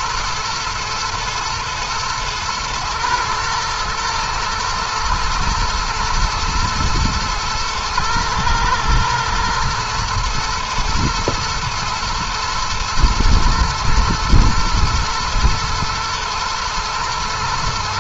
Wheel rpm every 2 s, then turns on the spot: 110, 110, 110, 110, 110, 120, 110, 110, 120.
none